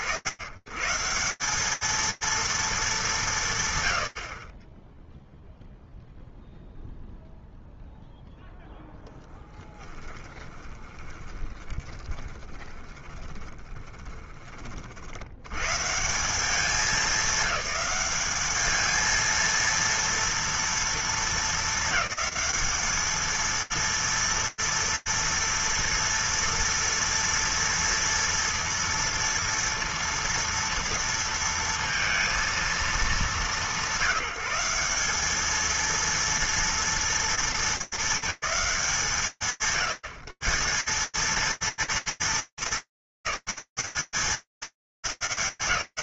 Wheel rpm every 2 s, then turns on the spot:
120, 220, 30, 0, 0, 10, 20, 90, 210, 230, 220, 220, 230, 230, 230, 230, 200, 220, 220, 130, 210, 230, 200.
10-14